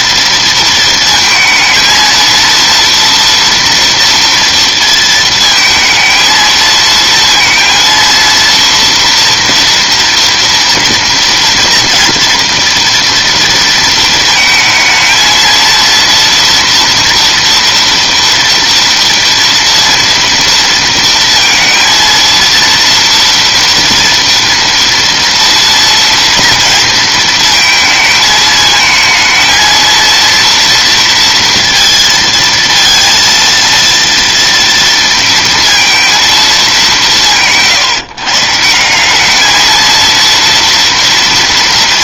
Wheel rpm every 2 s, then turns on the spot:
220, 240, 230, 230, 230, 230, 230, 230, 230, 230, 230, 230, 230, 230, 230, 230, 230, 230, 130, 220, 230.
none